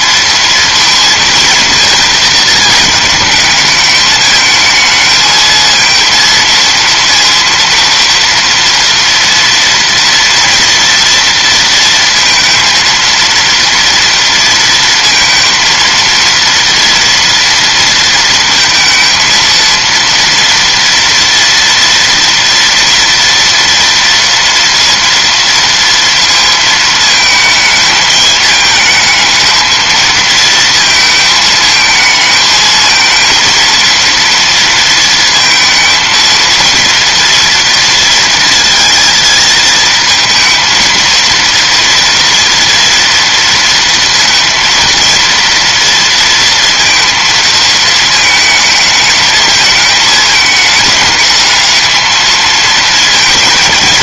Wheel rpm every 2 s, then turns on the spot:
230, 220, 220, 230, 230, 230, 230, 230, 230, 230, 230, 230, 230, 220, 220, 230, 220, 230, 230, 230, 230, 230, 230, 230, 220, 210, 220.
none